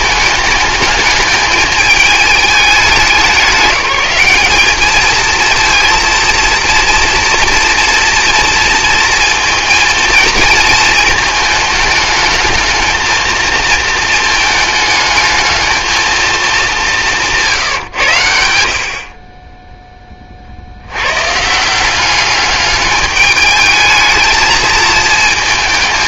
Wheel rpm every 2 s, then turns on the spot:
210, 210, 210, 230, 230, 230, 220, 220, 210, 60, 60, 200, 220.
none